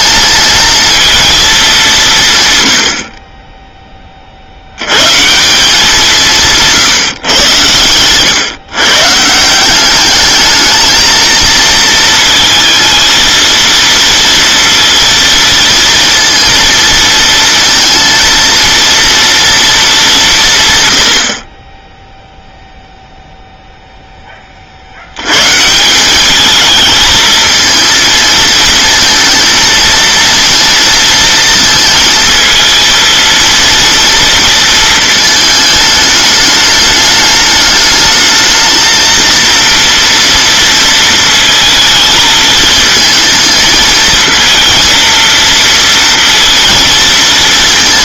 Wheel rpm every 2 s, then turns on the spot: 220, 110, 80, 160, 140, 220, 230, 230, 230, 230, 150, 0, 40, 220, 230, 230, 230, 230, 210, 220, 230, 220, 230, 230.
none